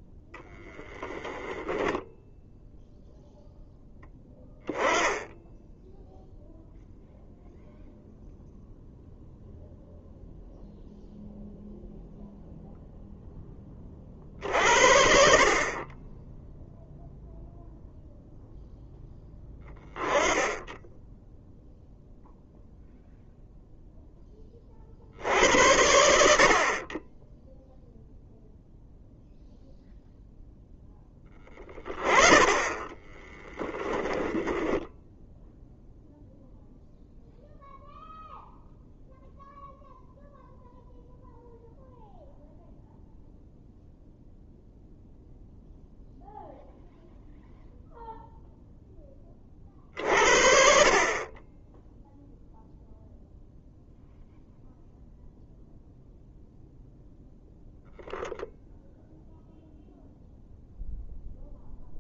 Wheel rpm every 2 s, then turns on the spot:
0, 0, 10, 0, 0, 0, 0, 50, 0, 0, 10, 0, 60, 30, 0, 10, 20, 10, 0, 0, 0, 0, 0, 0, 10, 50, 0, 0, 0, 0, 0.
32-34